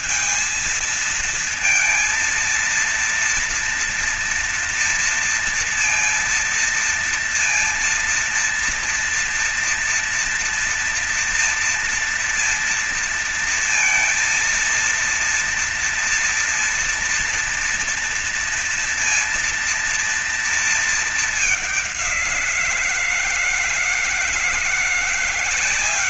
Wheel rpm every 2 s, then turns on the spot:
230, 230, 230, 230, 230, 240, 230, 230, 230, 230, 230, 170, 170.
none